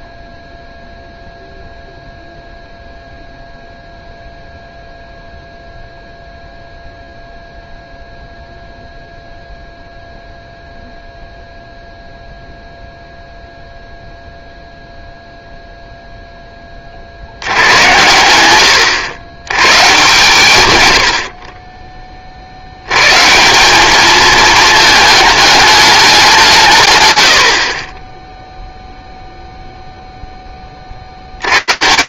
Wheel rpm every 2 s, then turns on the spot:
0, 0, 0, 0, 0, 0, 0, 0, 50, 110, 80, 110, 210, 120, 0, 70.
none